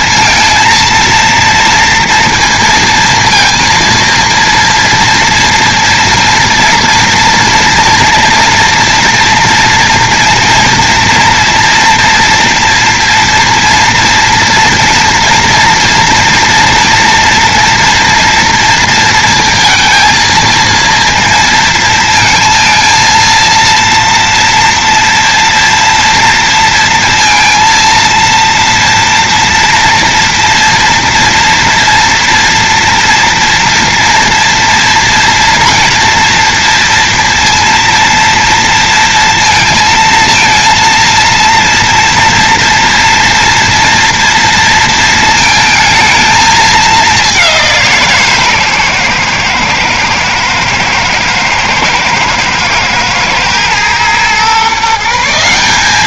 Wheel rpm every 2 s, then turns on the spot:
230, 230, 230, 240, 230, 230, 230, 230, 240, 230, 230, 230, 230, 230, 230, 230, 230, 240, 230, 230, 230, 230, 230, 200, 120, 110, 110, 160.
none